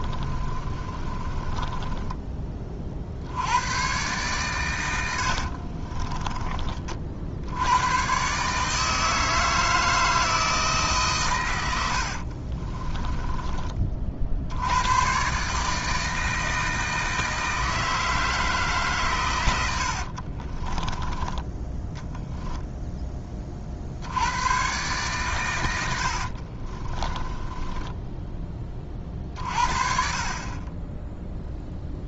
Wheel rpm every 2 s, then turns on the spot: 30, 40, 100, 40, 160, 150, 30, 100, 160, 140, 20, 10, 120, 30, 30, 20.
0-2 12-14 22-24 26-28